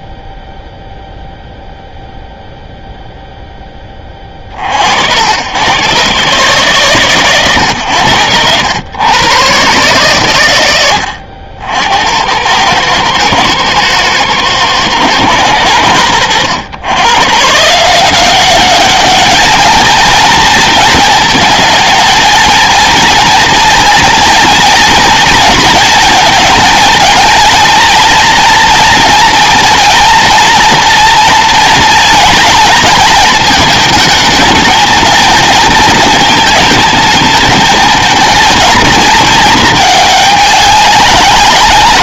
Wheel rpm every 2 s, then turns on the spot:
0, 0, 70, 140, 100, 100, 100, 110, 110, 200, 230, 230, 230, 220, 230, 230, 220, 220, 220, 230, 200.
none